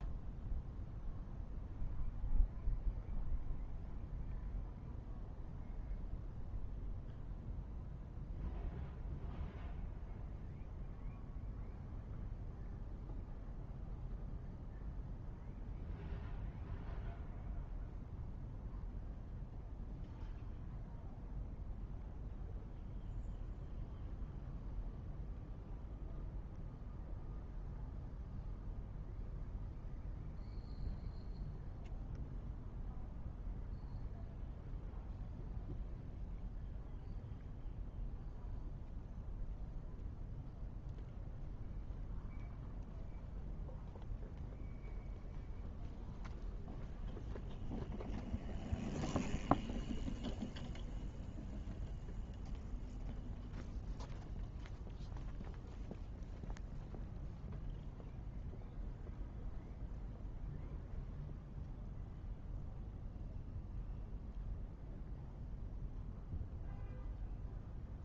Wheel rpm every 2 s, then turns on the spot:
0, 0, 0, 0, 0, 0, 0, 0, 0, 0, 0, 0, 0, 0, 0, 0, 0, 0, 0, 0, 0, 0, 0, 0, 0, 0, 0, 0, 0, 0, 0, 0, 0, 0.
none